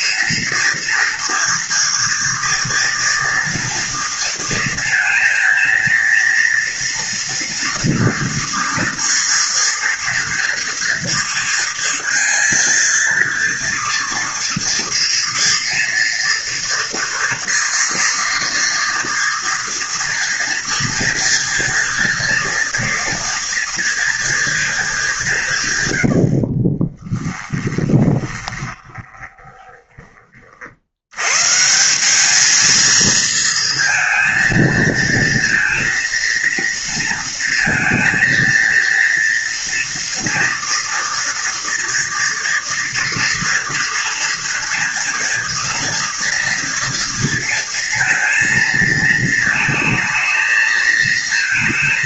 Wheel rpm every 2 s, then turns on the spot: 230, 240, 230, 230, 230, 230, 230, 230, 230, 230, 240, 230, 220, 40, 20, 50, 220, 230, 230, 230, 230, 230, 230, 230, 230, 220.
26-30